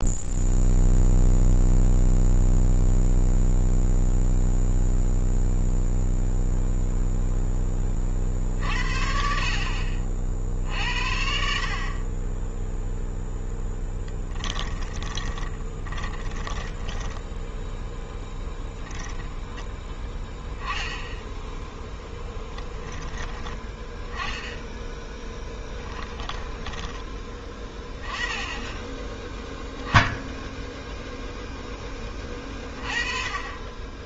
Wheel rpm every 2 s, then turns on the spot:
0, 0, 0, 0, 50, 60, 10, 10, 10, 10, 0, 10, 10, 10, 10, 0, 30.
14-18 26-28